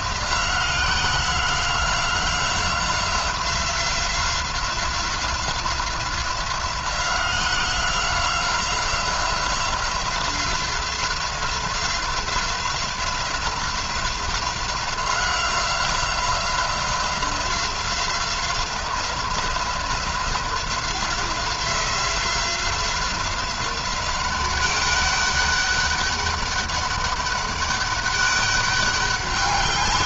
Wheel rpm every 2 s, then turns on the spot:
180, 180, 180, 180, 180, 180, 180, 180, 180, 180, 180, 180, 190, 200, 200.
none